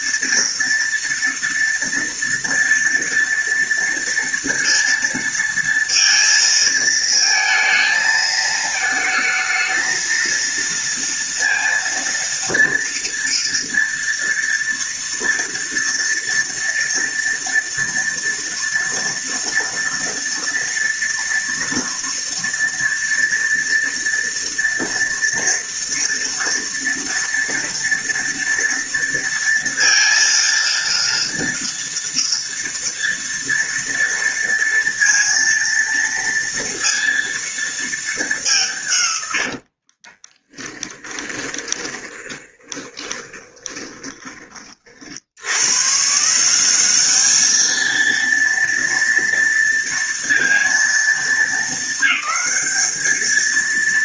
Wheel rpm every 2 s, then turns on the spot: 230, 230, 230, 230, 220, 230, 230, 230, 230, 240, 240, 240, 230, 230, 230, 230, 230, 230, 230, 150, 20, 20, 50, 200, 230, 230, 220.
40-44